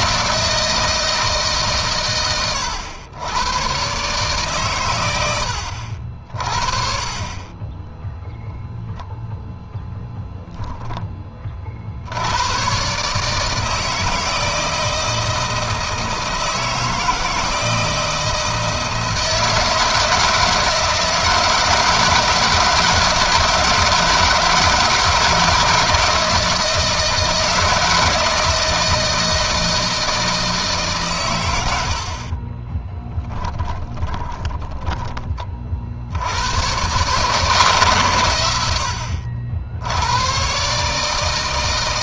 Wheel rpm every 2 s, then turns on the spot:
160, 110, 90, 20, 0, 20, 140, 160, 160, 160, 160, 160, 160, 160, 160, 130, 10, 20, 140, 80, 140.
32-34